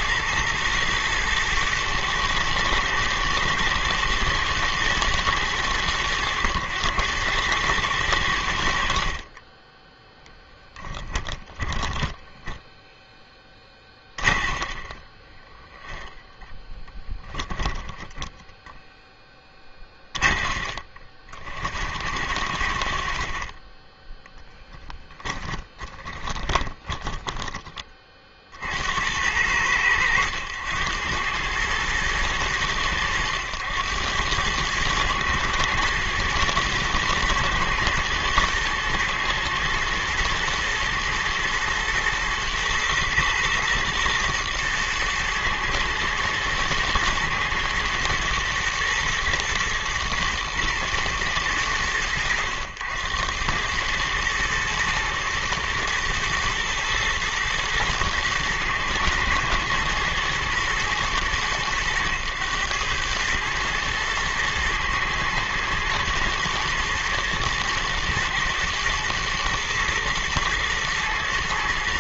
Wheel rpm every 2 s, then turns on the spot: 110, 110, 110, 110, 70, 20, 10, 30, 10, 10, 30, 70, 10, 20, 50, 90, 110, 100, 110, 110, 110, 120, 120, 110, 110, 120, 90, 110, 110, 120, 110, 110, 110, 120, 120, 110.
10-12 14-18 24-28